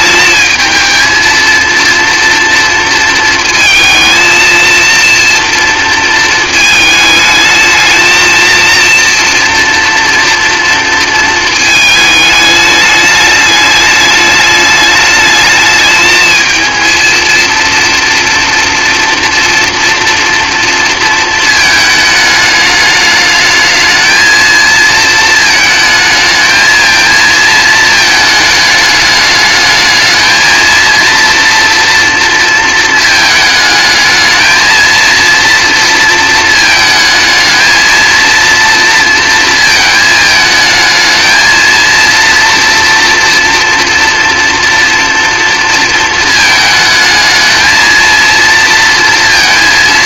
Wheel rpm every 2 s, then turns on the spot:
220, 230, 230, 230, 230, 230, 210, 210, 220, 230, 230, 210, 230, 220, 210, 220, 230, 220, 220, 230, 220, 230, 240, 220, 230.
none